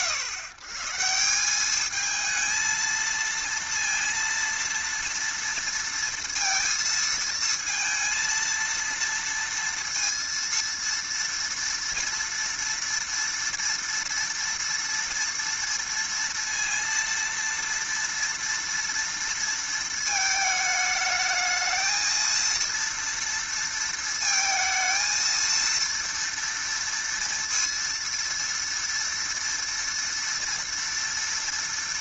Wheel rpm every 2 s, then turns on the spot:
130, 230, 230, 230, 230, 230, 230, 240, 230, 230, 220, 230, 220, 230, 230, 230.
none